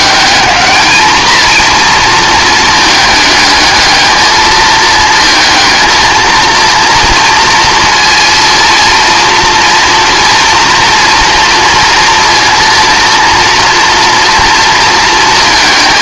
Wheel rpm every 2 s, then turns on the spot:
220, 220, 220, 230, 230, 230, 230, 230.
none